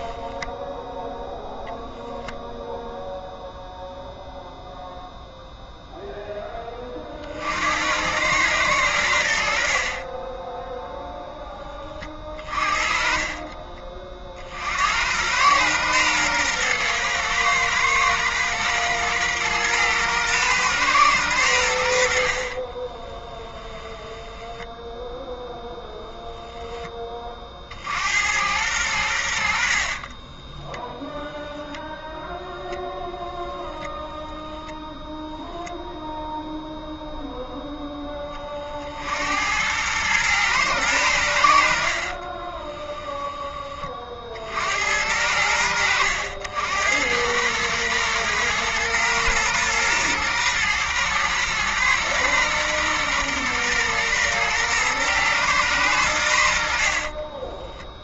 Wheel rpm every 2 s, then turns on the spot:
10, 0, 0, 40, 80, 0, 30, 90, 110, 120, 110, 20, 0, 20, 90, 0, 0, 0, 0, 70, 100, 10, 80, 90, 110, 120, 120, 110, 40.
22-24 42-44 56-58